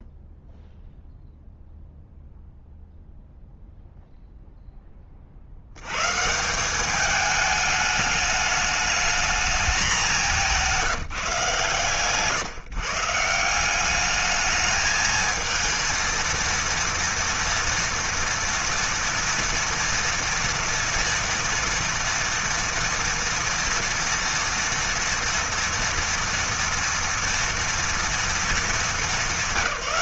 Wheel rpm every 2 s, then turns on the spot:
0, 0, 40, 210, 220, 170, 160, 220, 230, 230, 230, 230, 230, 230, 200.
none